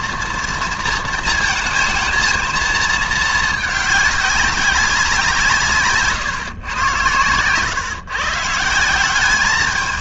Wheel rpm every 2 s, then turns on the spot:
230, 230, 200, 120, 160.
none